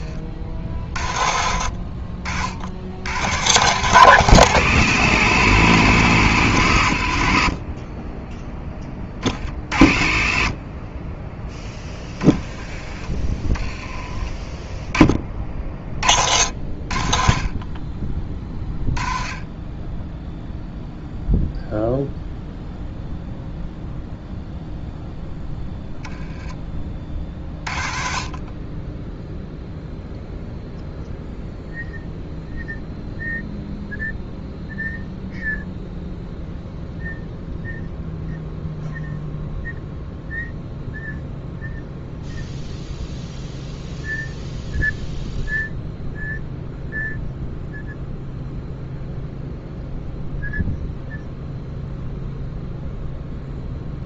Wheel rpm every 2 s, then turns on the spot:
40, 70, 150, 100, 10, 40, 20, 10, 60, 20, 0, 0, 0, 20, 30, 0, 0, 0, 0, 0, 0, 0, 0, 0, 0, 0, 0.
none